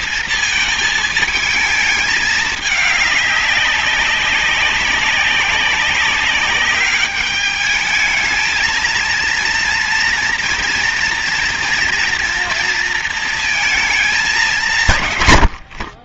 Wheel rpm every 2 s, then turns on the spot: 220, 210, 190, 210, 230, 230, 230, 160.
none